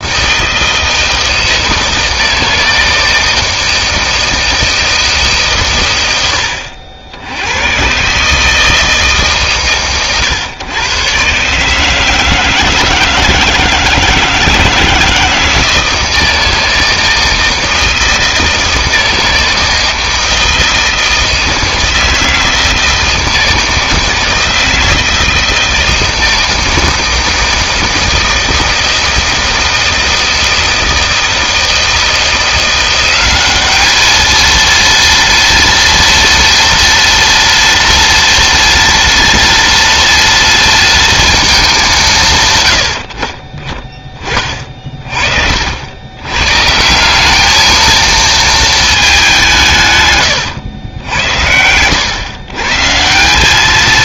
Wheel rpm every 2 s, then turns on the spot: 160, 160, 160, 70, 160, 120, 160, 160, 160, 160, 160, 160, 160, 160, 160, 160, 180, 230, 230, 230, 230, 100, 40, 150, 220, 100, 140.
none